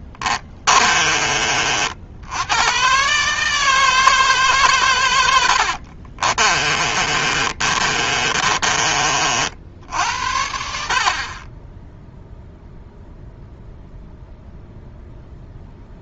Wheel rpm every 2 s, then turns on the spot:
30, 120, 120, 30, 30, 50, 0, 0.
0-2 6-8